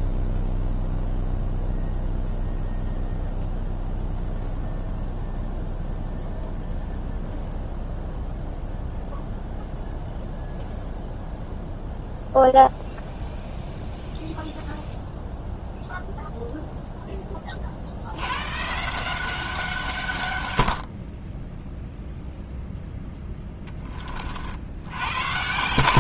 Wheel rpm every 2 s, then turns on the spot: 0, 0, 0, 0, 0, 0, 0, 0, 0, 150, 80, 0, 60.
none